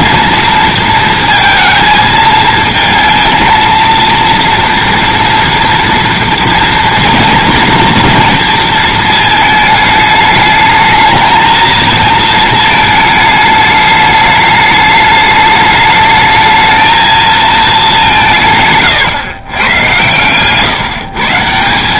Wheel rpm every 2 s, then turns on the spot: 230, 220, 230, 240, 230, 220, 220, 210, 220, 160, 130.
none